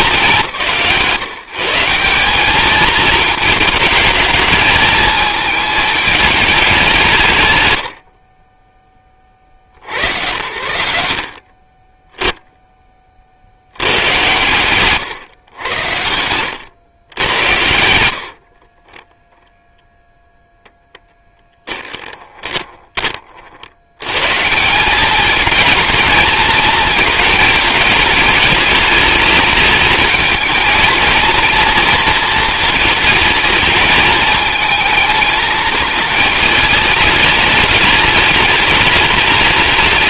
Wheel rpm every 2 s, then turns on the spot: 130, 220, 220, 180, 10, 60, 30, 120, 110, 30, 0, 20, 190, 220, 210, 220, 220, 220, 220, 210.
16-20